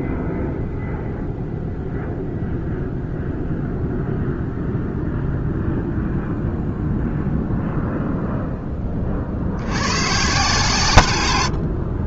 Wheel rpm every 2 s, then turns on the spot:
0, 0, 0, 0, 10, 140.
none